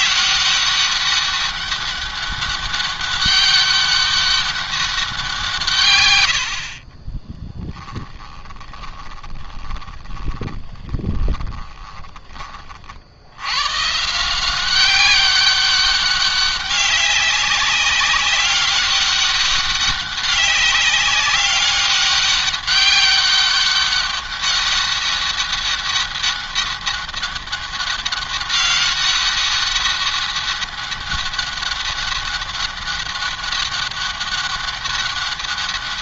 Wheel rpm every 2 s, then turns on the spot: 190, 200, 190, 40, 20, 20, 50, 190, 200, 200, 200, 200, 200, 200, 200, 200, 200, 200.
6-12